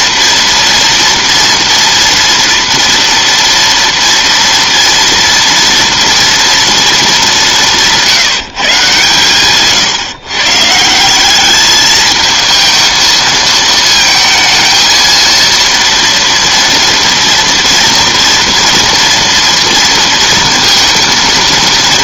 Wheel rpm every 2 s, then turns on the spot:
230, 230, 230, 230, 150, 150, 220, 220, 240, 230, 230.
none